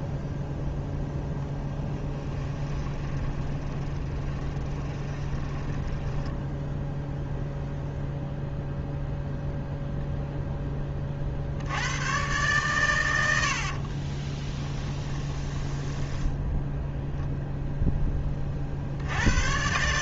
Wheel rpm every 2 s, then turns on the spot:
0, 20, 20, 0, 0, 20, 110, 20, 0, 60.
2-6 14-16